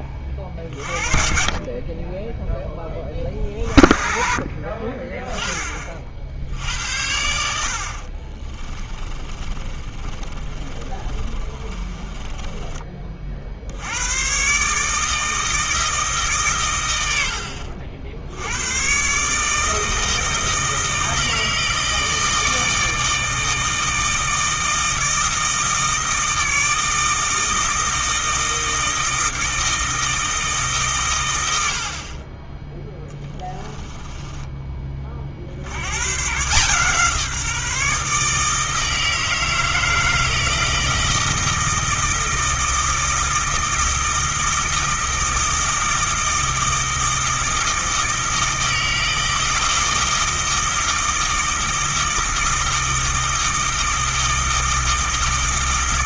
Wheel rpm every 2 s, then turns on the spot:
40, 20, 30, 80, 30, 30, 30, 150, 100, 120, 160, 160, 160, 160, 160, 140, 10, 30, 150, 160, 160, 160, 160, 160, 160, 160, 160, 160.
8-12